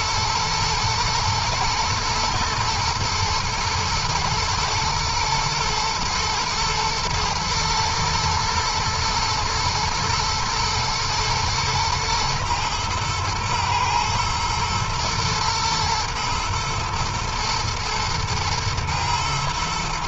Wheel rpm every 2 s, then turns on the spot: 110, 110, 110, 120, 120, 120, 120, 120, 110, 110.
none